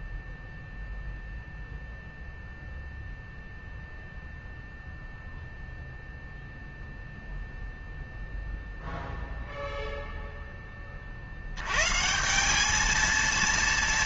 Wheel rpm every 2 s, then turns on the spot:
0, 0, 0, 0, 0, 40, 220.
none